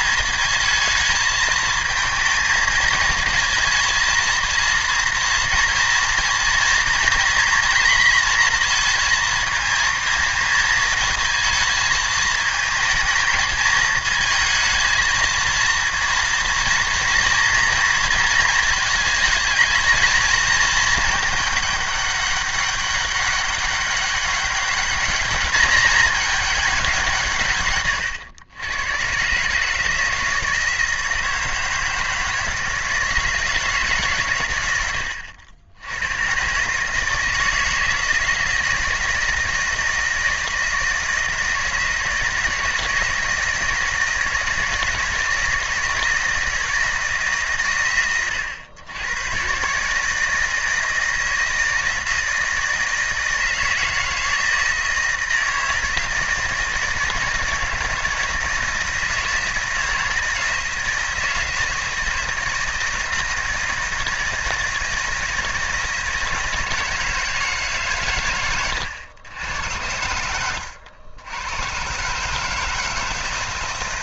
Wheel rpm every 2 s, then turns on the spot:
220, 230, 230, 230, 230, 220, 220, 220, 230, 220, 220, 200, 200, 200, 100, 160, 160, 100, 130, 160, 160, 170, 160, 160, 100, 160, 160, 160, 160, 160, 160, 160, 160, 160, 110, 90, 150.
none